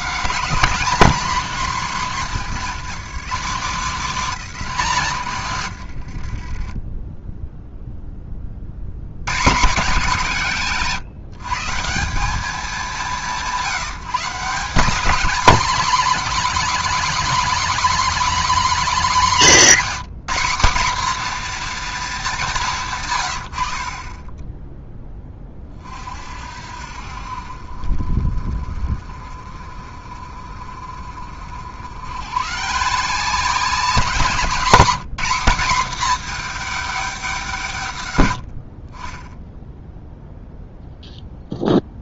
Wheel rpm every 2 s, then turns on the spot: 190, 160, 170, 20, 60, 160, 200, 170, 210, 220, 210, 160, 10, 60, 30, 40, 140, 210, 220, 40, 0.
none